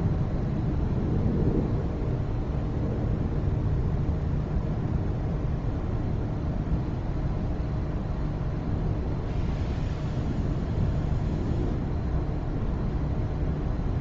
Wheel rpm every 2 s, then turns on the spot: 0, 0, 0, 0, 0, 0, 0.
none